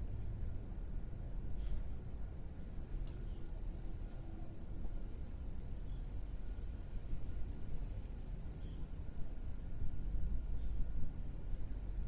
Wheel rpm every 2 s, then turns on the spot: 0, 0, 0, 0, 0, 0.
none